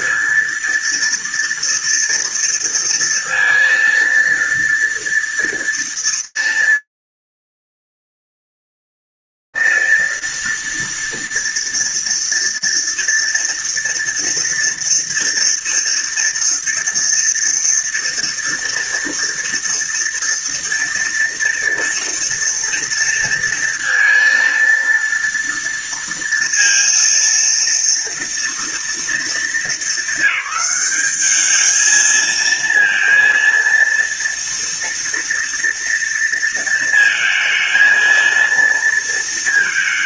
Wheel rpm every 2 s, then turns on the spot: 230, 230, 230, 230, 230, 230, 230, 230, 230, 230, 230, 230, 230, 230, 230, 220, 220, 230, 230, 230.
none